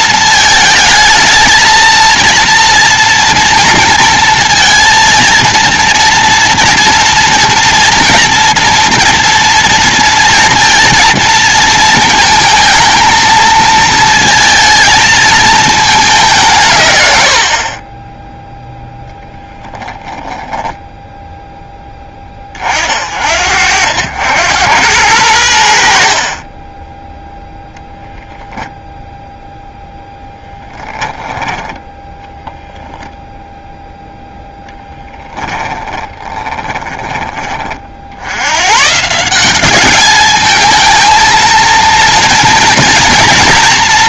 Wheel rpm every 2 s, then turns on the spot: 220, 240, 230, 230, 230, 230, 220, 230, 150, 0, 10, 40, 90, 20, 0, 10, 0, 0, 20, 110, 220, 230.
36-38